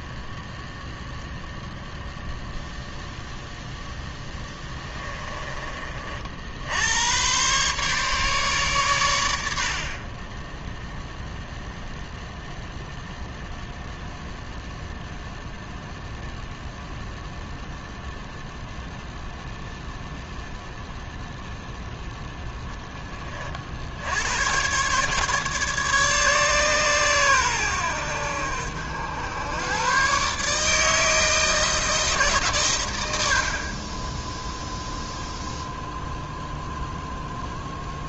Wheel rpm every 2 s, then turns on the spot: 0, 0, 20, 100, 100, 0, 0, 0, 0, 0, 0, 10, 140, 130, 80, 160, 90, 0, 0.
4-6